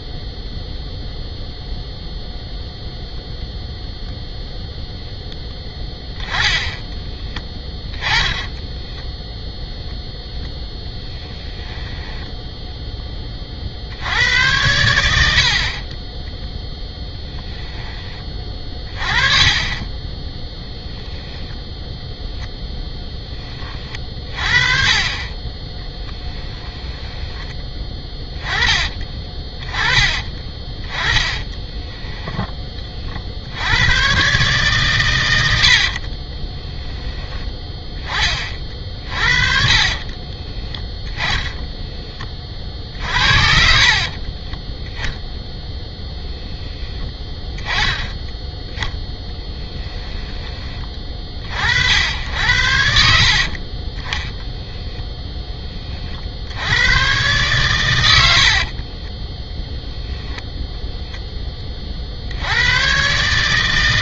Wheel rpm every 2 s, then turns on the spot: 0, 0, 0, 10, 10, 10, 10, 100, 10, 30, 0, 0, 30, 10, 20, 20, 30, 130, 10, 40, 20, 50, 10, 10, 10, 20, 70, 0, 90, 50, 0, 110.
8-12 18-20 26-32 38-44 58-60